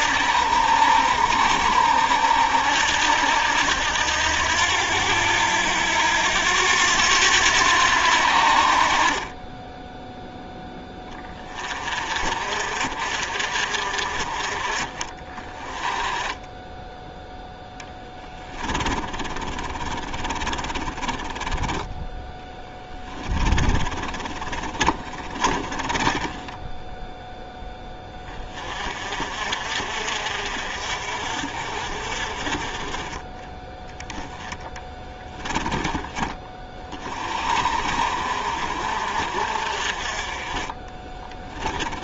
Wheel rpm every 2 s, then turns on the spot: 70, 80, 80, 90, 40, 10, 50, 30, 0, 40, 40, 10, 40, 10, 40, 50, 30, 20, 30, 50, 20.
18-28 34-36 40-42